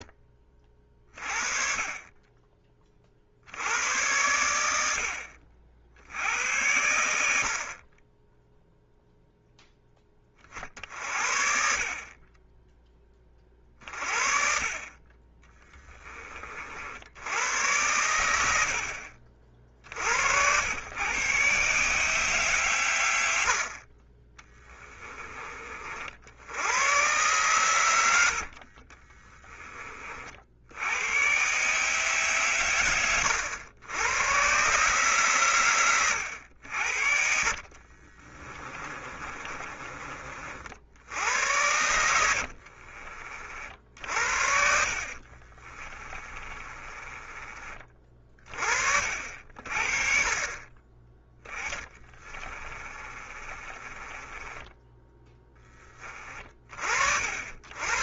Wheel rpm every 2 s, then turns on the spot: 30, 30, 80, 90, 0, 50, 20, 30, 60, 50, 110, 120, 20, 100, 40, 90, 110, 140, 70, 30, 70, 50, 50, 20, 50, 20, 30, 10, 50.
24-26 28-30 38-40 42-48 52-56